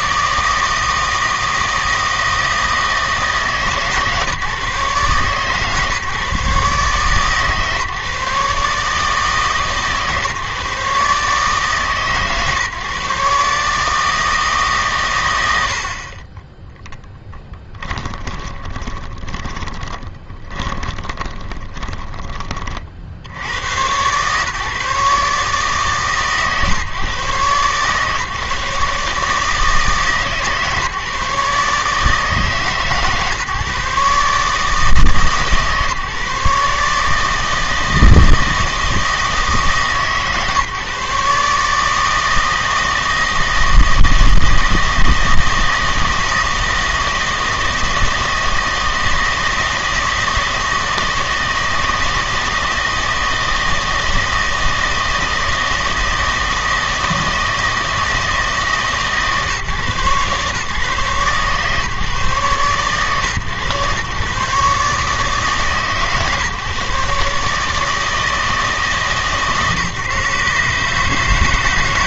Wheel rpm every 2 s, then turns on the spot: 160, 160, 140, 140, 150, 150, 130, 140, 10, 20, 20, 40, 140, 140, 150, 150, 150, 150, 150, 160, 150, 160, 160, 160, 160, 160, 160, 160, 160, 160, 140, 130, 130, 140, 150, 140.
18-22